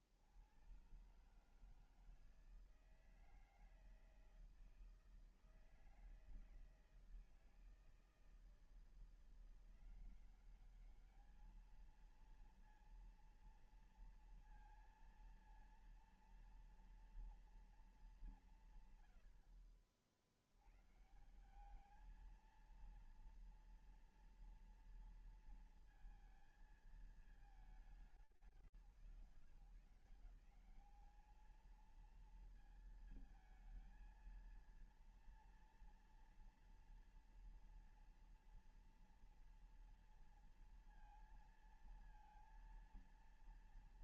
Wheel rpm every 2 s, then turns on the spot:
90, 160, 160, 160, 160, 190, 230, 230, 230, 200, 80, 220, 230, 230, 170, 190, 230, 230, 230, 230, 230, 230.
none